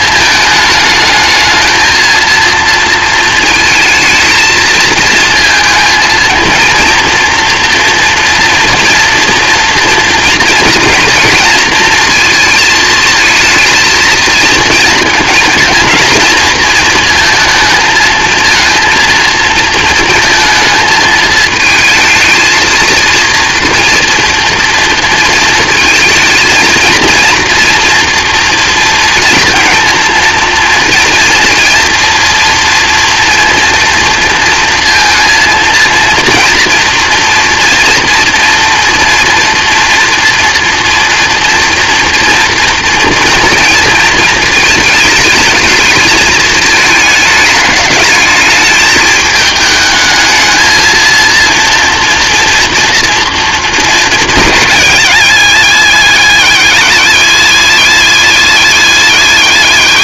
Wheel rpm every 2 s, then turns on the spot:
220, 230, 220, 230, 230, 240, 230, 230, 230, 230, 220, 220, 230, 230, 230, 230, 240, 230, 240, 230, 230, 230, 220, 220, 220, 220, 230, 170, 110, 110.
none